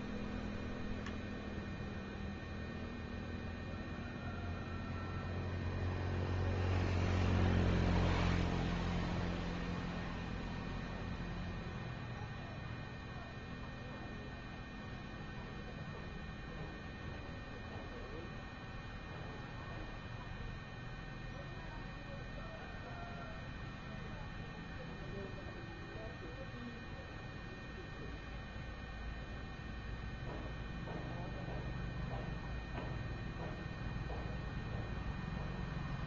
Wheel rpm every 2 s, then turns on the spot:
0, 0, 0, 0, 0, 0, 0, 0, 0, 0, 0, 0, 0, 0, 0, 0, 0, 0.
none